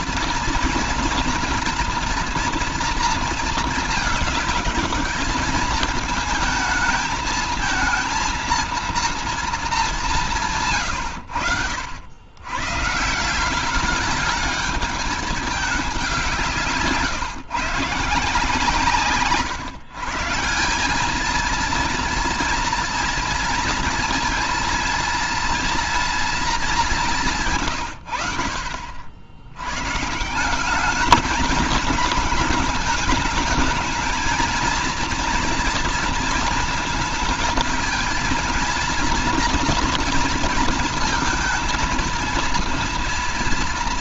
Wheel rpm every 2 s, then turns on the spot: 230, 230, 220, 220, 230, 130, 160, 210, 150, 150, 190, 230, 230, 200, 60, 210, 220, 230, 220, 230, 230, 230.
none